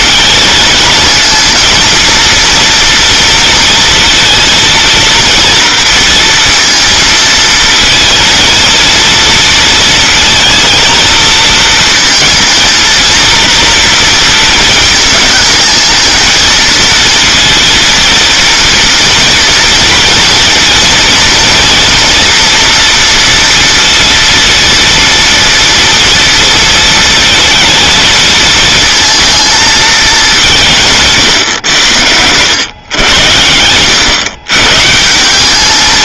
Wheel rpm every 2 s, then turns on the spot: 230, 240, 230, 230, 230, 230, 230, 220, 230, 230, 230, 230, 230, 230, 220, 160, 100, 140.
none